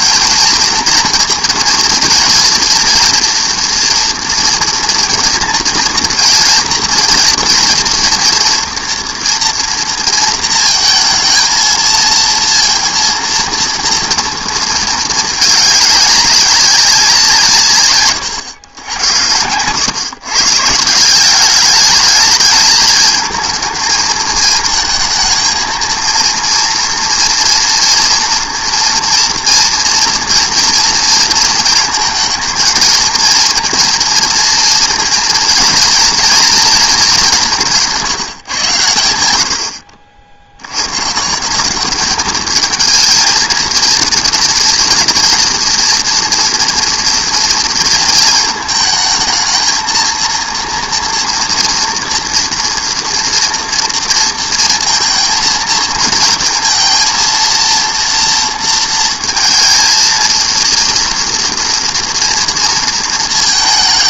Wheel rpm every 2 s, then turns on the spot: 230, 230, 230, 220, 230, 230, 230, 230, 200, 110, 150, 220, 220, 230, 240, 230, 220, 230, 230, 130, 80, 210, 220, 230, 220, 230, 240, 230, 230, 230, 230, 230.
none